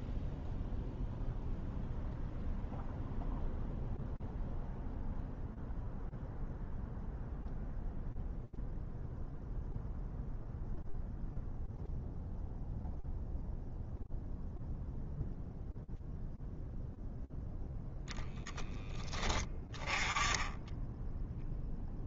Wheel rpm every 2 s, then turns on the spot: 0, 0, 0, 0, 0, 0, 0, 0, 0, 10, 0.
none